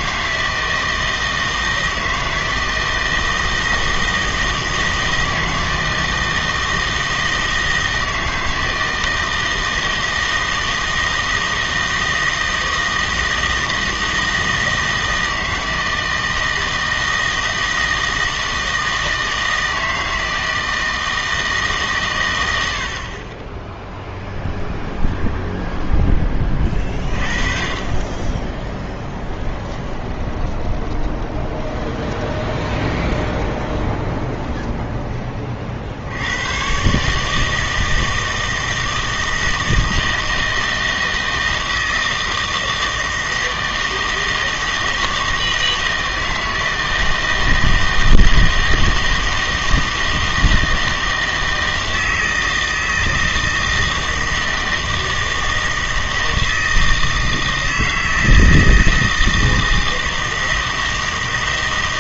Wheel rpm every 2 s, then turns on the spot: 160, 160, 160, 160, 160, 160, 160, 160, 160, 160, 160, 70, 0, 30, 10, 20, 20, 20, 130, 160, 160, 160, 160, 160, 160, 160, 160, 160, 160, 160, 160.
30-36